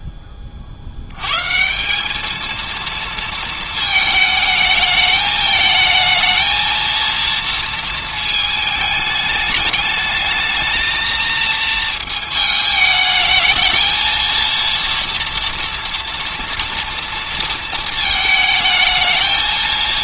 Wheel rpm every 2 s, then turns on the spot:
30, 220, 220, 220, 220, 220, 220, 230, 230, 220.
none